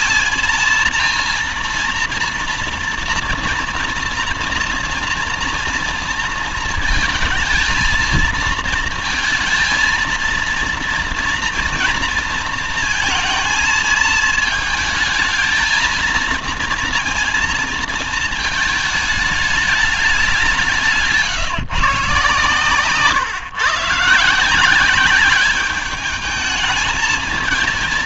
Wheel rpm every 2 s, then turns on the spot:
230, 230, 230, 230, 230, 240, 230, 220, 230, 210, 160, 130, 190, 220.
none